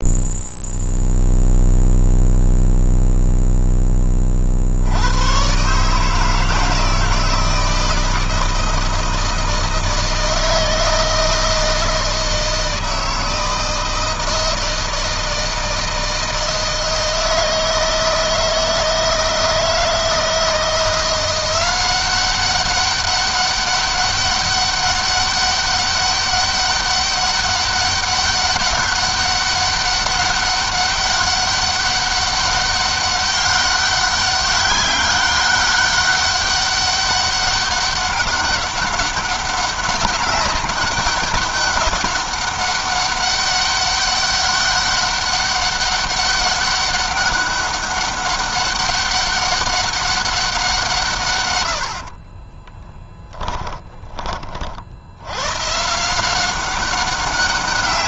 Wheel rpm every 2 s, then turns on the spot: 0, 0, 80, 160, 160, 160, 160, 160, 160, 160, 170, 200, 200, 200, 200, 200, 200, 200, 200, 200, 200, 200, 200, 200, 200, 170, 10, 80, 190.
52-54